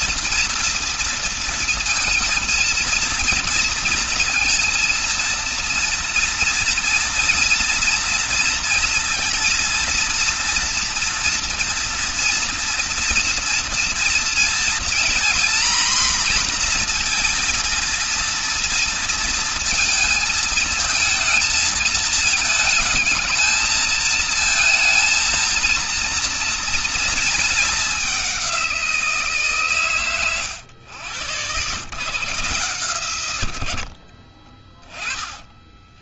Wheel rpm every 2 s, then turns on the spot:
230, 230, 230, 230, 230, 240, 240, 240, 230, 230, 230, 220, 220, 230, 180, 100, 120, 20.
none